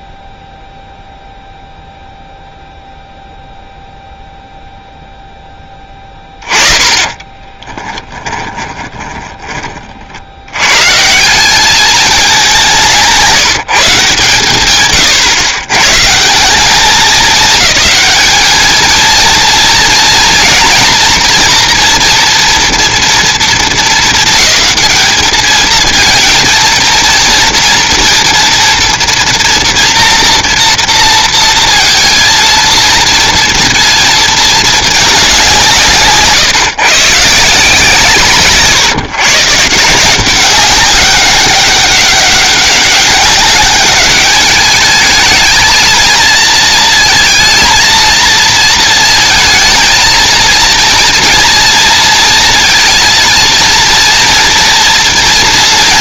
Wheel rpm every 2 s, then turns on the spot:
0, 0, 0, 20, 20, 140, 180, 130, 200, 230, 230, 230, 220, 230, 230, 230, 230, 220, 140, 140, 190, 200, 220, 230, 230, 230, 220, 230.
6-10